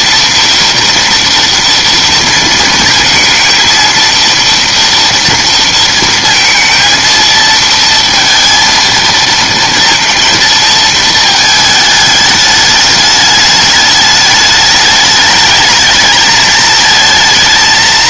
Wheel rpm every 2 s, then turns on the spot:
230, 230, 230, 230, 230, 220, 210, 210, 220.
none